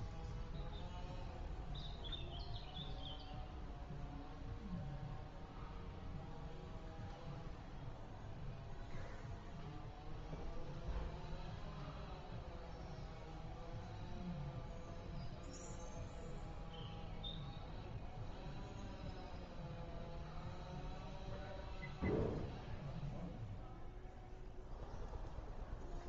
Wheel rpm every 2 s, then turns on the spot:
0, 0, 0, 0, 0, 0, 0, 0, 0, 0, 0, 0, 0.
none